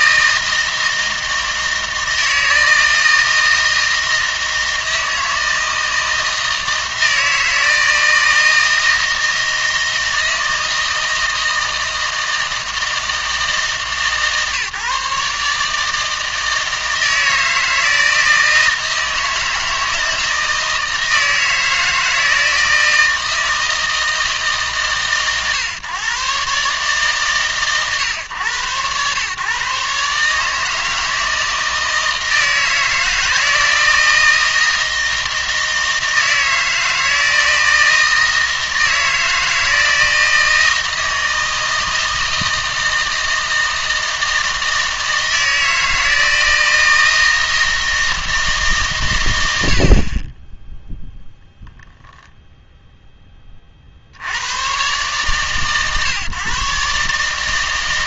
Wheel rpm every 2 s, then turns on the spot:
160, 160, 160, 160, 160, 160, 160, 140, 160, 160, 160, 160, 140, 140, 110, 160, 160, 160, 160, 160, 160, 160, 160, 160, 150, 10, 10, 120, 140.
none